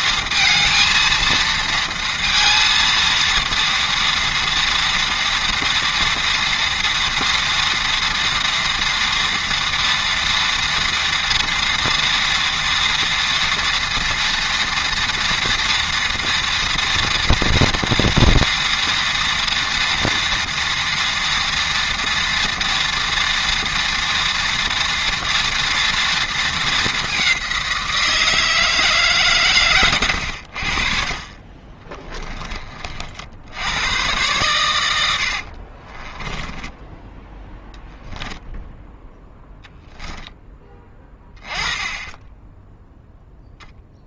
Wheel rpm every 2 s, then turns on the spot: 230, 230, 230, 230, 240, 230, 230, 230, 240, 230, 230, 230, 230, 210, 160, 60, 40, 110, 10, 0, 10, 0.
36-38